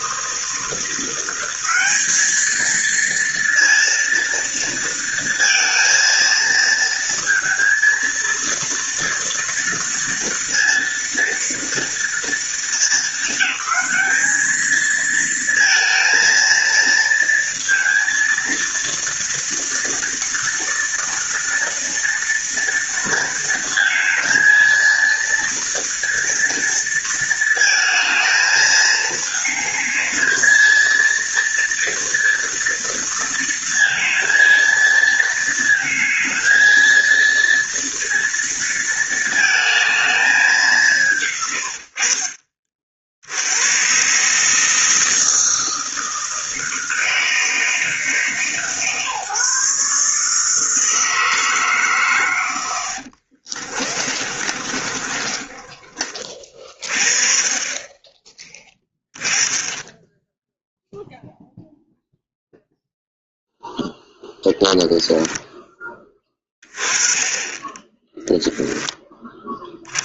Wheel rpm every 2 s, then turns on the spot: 170, 230, 230, 230, 230, 230, 220, 220, 230, 230, 240, 230, 230, 230, 220, 230, 230, 230, 230, 220, 180, 50, 160, 160, 150, 160, 90, 30, 40, 10, 0, 0, 0, 10, 0.
52-56